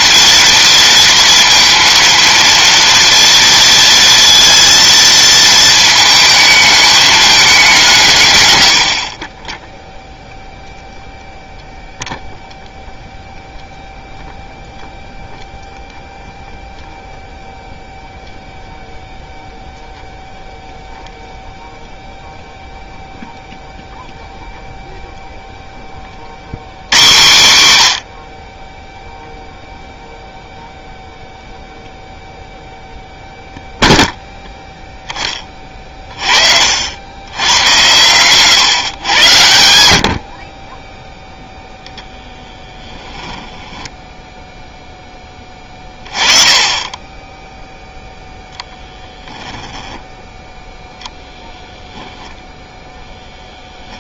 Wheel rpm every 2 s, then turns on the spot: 230, 230, 230, 210, 100, 0, 0, 0, 0, 0, 0, 0, 0, 110, 20, 0, 0, 0, 60, 150, 30, 10, 0, 20, 10, 0, 0.
42-44 48-50